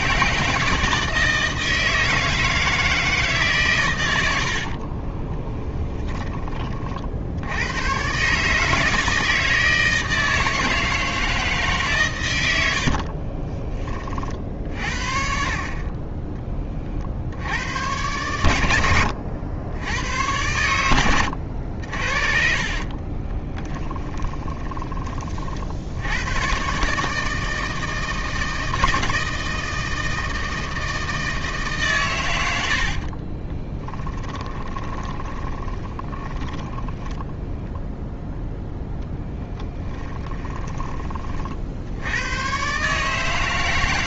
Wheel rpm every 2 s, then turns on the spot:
160, 160, 50, 40, 150, 160, 70, 50, 30, 90, 110, 40, 20, 130, 160, 160, 70, 20, 10, 0, 30, 150.
4-6 12-14 18-26 34-38